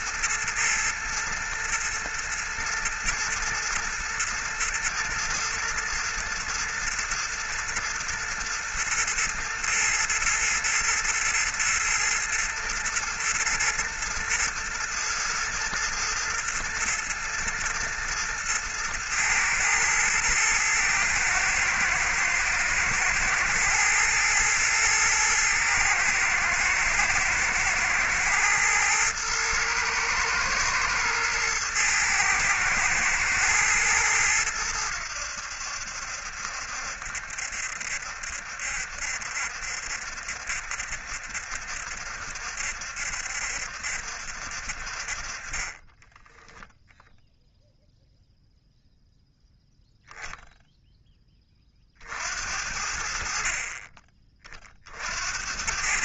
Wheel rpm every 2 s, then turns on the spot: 110, 110, 110, 120, 120, 110, 110, 110, 110, 110, 110, 110, 110, 110, 110, 120, 110, 90, 70, 70, 70, 70, 50, 0, 0, 10, 60, 50.
none